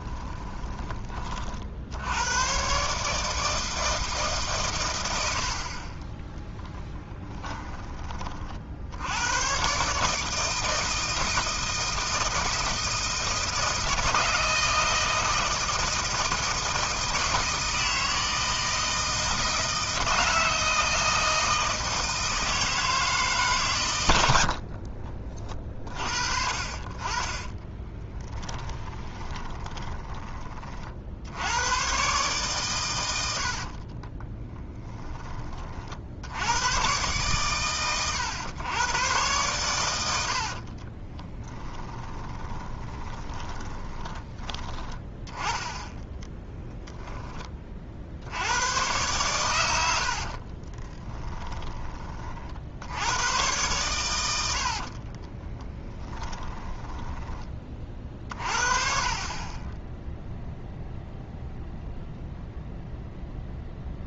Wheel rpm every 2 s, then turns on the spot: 20, 130, 110, 10, 60, 160, 160, 160, 160, 160, 160, 160, 60, 40, 20, 40, 120, 10, 110, 110, 40, 20, 10, 10, 110, 30, 70, 60, 20, 50, 0, 0.
0-2 6-8 24-26 28-30 40-44 50-52 54-58